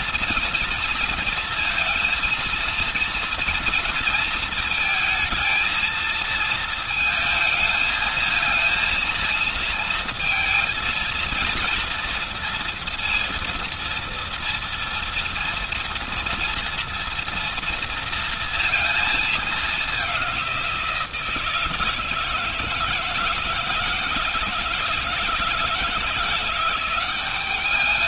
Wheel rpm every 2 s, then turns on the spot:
230, 230, 230, 230, 230, 230, 230, 230, 240, 230, 180, 160, 160, 180.
none